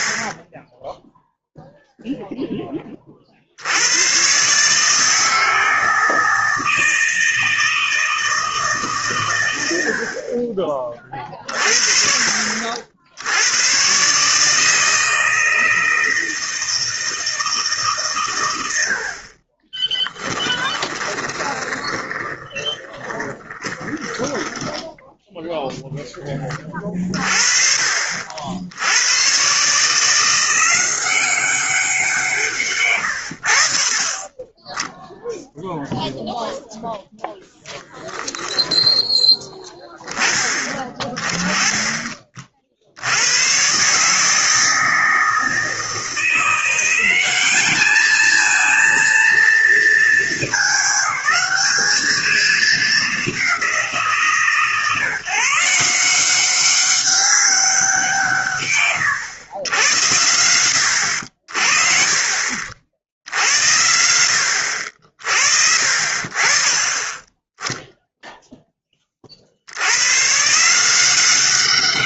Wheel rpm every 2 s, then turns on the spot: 0, 120, 160, 160, 30, 50, 140, 160, 110, 10, 20, 20, 0, 40, 160, 170, 40, 0, 10, 10, 20, 130, 160, 210, 220, 210, 180, 160, 190, 90, 50, 70, 50, 10, 40, 190.
18-24